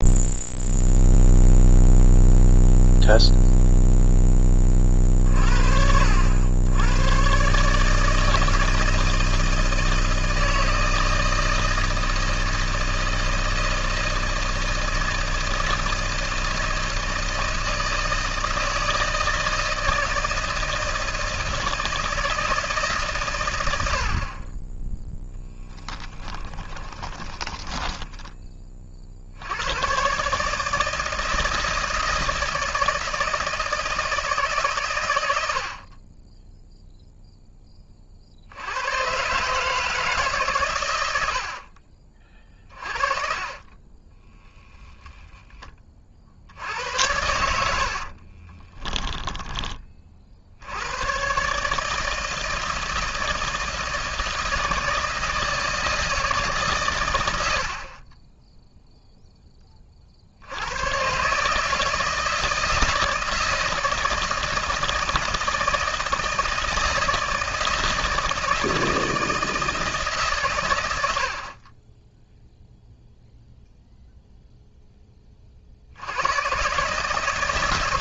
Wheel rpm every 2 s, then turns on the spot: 0, 0, 40, 90, 160, 160, 160, 160, 160, 160, 160, 150, 10, 20, 40, 160, 160, 130, 0, 110, 110, 40, 0, 80, 20, 100, 160, 160, 130, 0, 110, 160, 160, 160, 160, 100, 0, 10, 140.
26-28 42-44 48-50